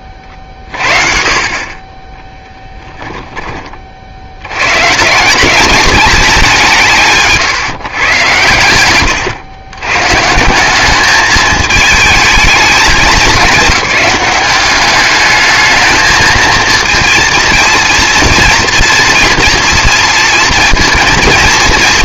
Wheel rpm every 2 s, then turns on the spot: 40, 10, 130, 160, 100, 190, 210, 200, 230, 230, 230.
8-10